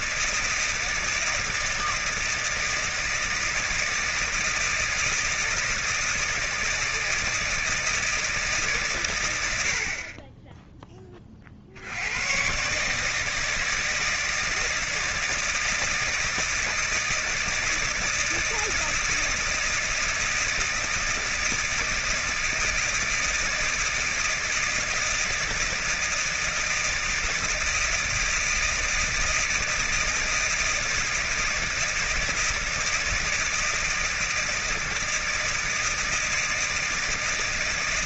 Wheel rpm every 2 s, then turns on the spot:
160, 160, 160, 160, 150, 10, 130, 160, 160, 160, 160, 160, 160, 160, 160, 160, 160, 160, 160.
none